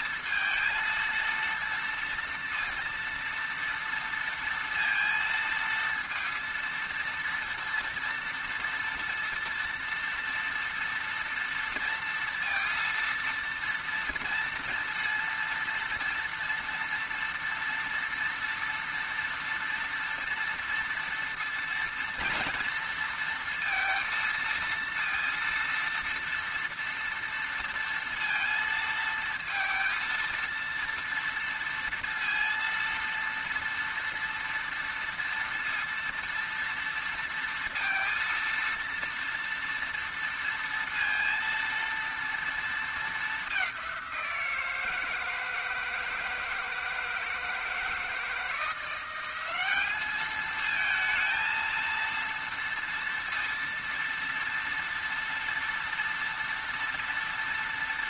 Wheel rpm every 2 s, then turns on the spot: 230, 230, 230, 230, 230, 230, 230, 230, 230, 230, 230, 230, 230, 230, 230, 230, 230, 230, 230, 230, 230, 220, 170, 160, 170, 220, 230, 230, 230.
none